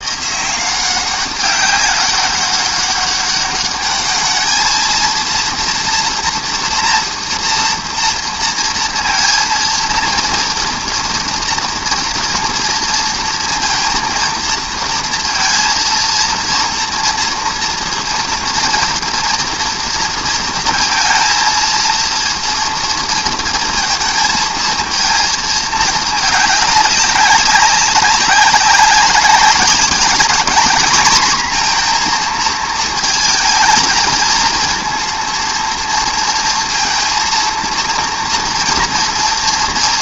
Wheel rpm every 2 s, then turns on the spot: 190, 200, 230, 230, 230, 230, 230, 230, 230, 230, 230, 230, 230, 200, 200, 230, 220, 230, 230, 230.
none